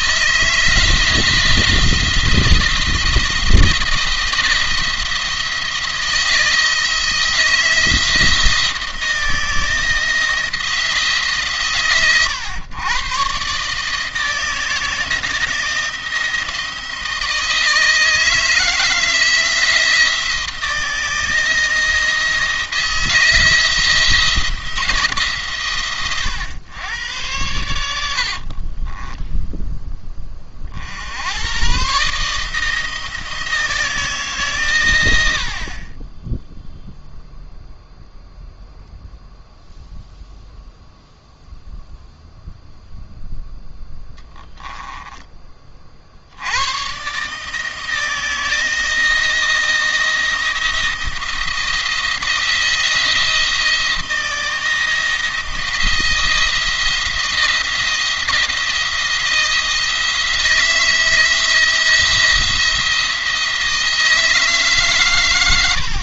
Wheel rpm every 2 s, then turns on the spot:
160, 170, 170, 160, 170, 160, 120, 160, 160, 160, 170, 160, 160, 110, 40, 50, 160, 130, 0, 0, 0, 0, 10, 110, 160, 170, 170, 170, 170, 170, 170, 170, 150.
28-30